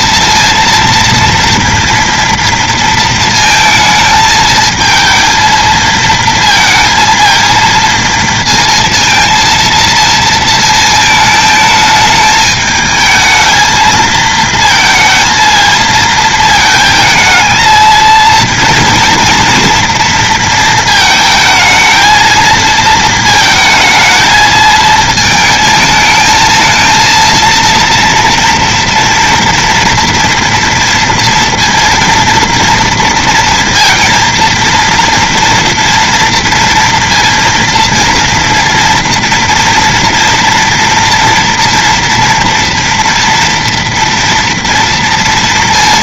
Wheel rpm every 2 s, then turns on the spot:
230, 230, 220, 230, 230, 220, 220, 220, 220, 230, 220, 230, 220, 220, 230, 230, 230, 230, 230, 230, 230, 230, 230.
none